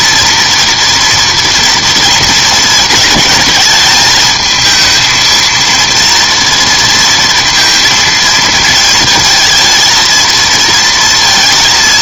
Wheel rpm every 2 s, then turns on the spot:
230, 230, 220, 230, 220, 230.
none